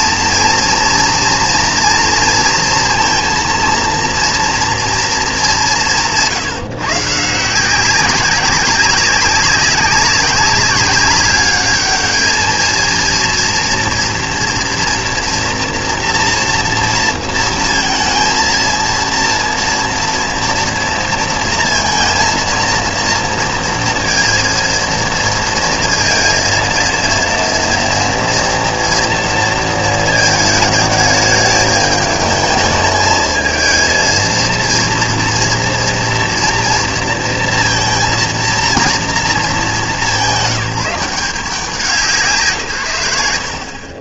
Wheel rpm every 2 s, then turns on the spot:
230, 230, 230, 130, 190, 200, 220, 230, 230, 230, 230, 230, 230, 230, 230, 220, 220, 230, 230, 230, 180, 160.
none